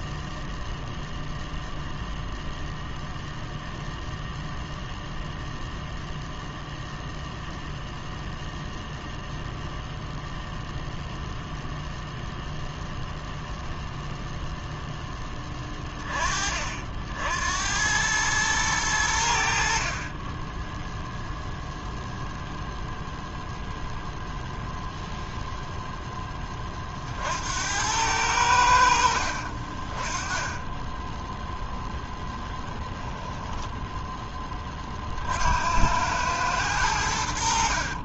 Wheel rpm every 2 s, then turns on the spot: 0, 0, 0, 0, 0, 0, 0, 0, 50, 110, 10, 0, 0, 30, 90, 20, 10, 20, 100.
30-32